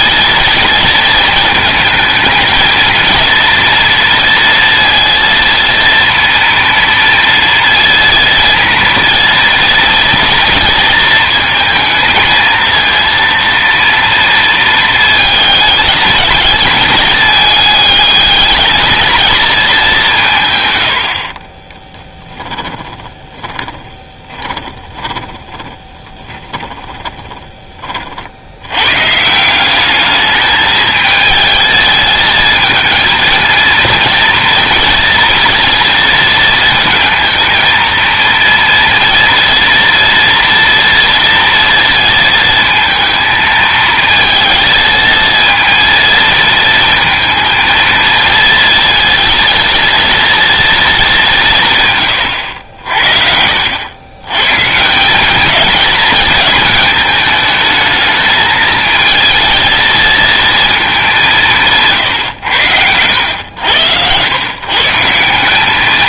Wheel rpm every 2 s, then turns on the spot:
230, 230, 230, 230, 230, 230, 230, 230, 220, 220, 100, 10, 20, 20, 110, 220, 220, 230, 230, 230, 230, 230, 220, 230, 230, 230, 70, 150, 220, 220, 220, 90, 140.
22-28